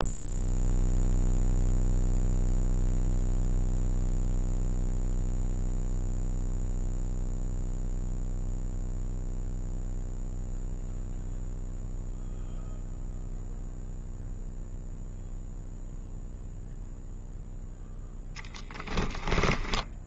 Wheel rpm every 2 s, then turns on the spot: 0, 0, 0, 0, 0, 0, 0, 0, 0, 10.
18-20